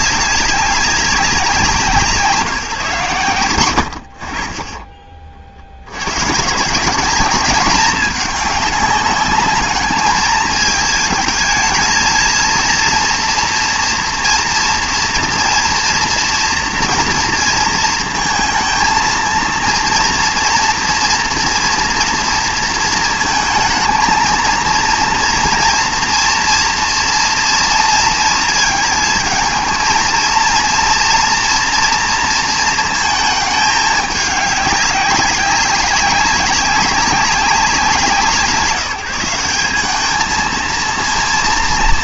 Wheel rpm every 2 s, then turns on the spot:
200, 160, 50, 160, 210, 220, 230, 230, 240, 220, 230, 230, 230, 240, 230, 230, 230, 200, 200, 170, 220.
none